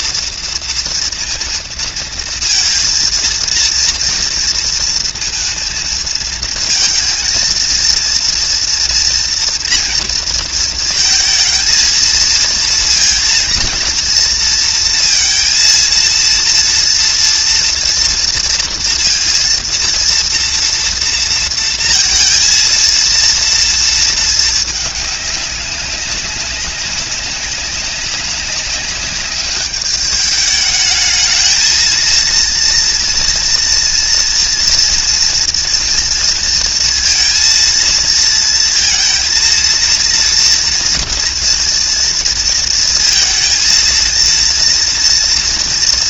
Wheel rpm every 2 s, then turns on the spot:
230, 230, 230, 220, 230, 230, 230, 230, 230, 230, 230, 230, 220, 200, 190, 210, 230, 230, 230, 230, 230, 230, 230.
none